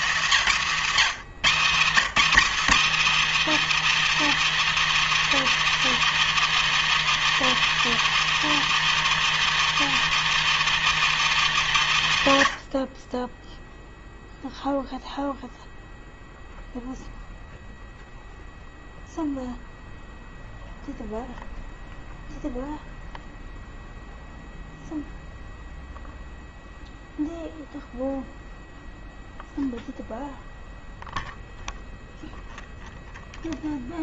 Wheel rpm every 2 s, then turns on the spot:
200, 270, 340, 340, 340, 340, 140, 0, 0, 0, 0, 0, 0, 0, 0, 0, 0.
none